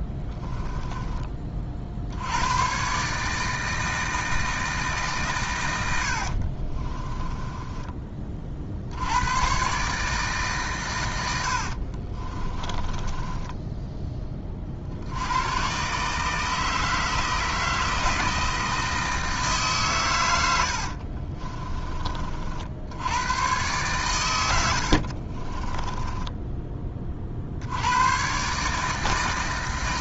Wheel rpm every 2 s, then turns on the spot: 10, 120, 160, 30, 70, 120, 20, 40, 160, 160, 80, 70, 70, 20, 150.
0-2 6-8 12-14 20-22 24-26